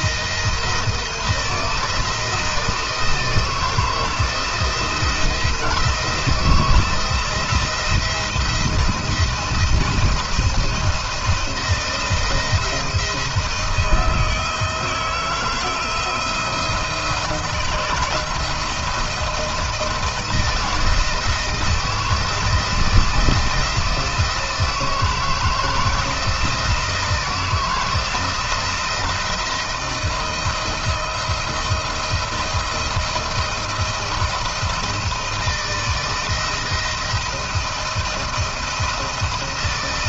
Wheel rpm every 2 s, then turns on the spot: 160, 160, 160, 160, 170, 170, 170, 170, 170, 170, 160, 170, 160, 160, 160, 170, 170, 160, 170, 170.
none